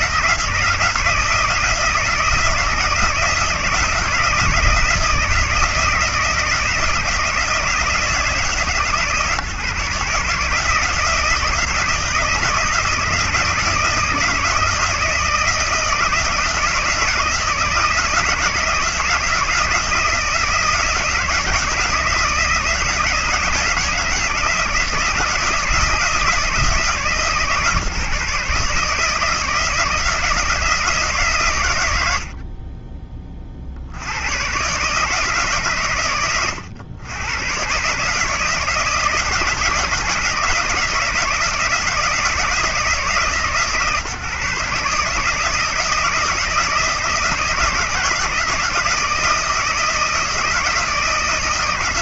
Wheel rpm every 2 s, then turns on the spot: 170, 160, 160, 160, 150, 160, 160, 160, 160, 170, 160, 160, 160, 160, 160, 150, 30, 140, 110, 160, 160, 150, 150, 160, 170, 160.
none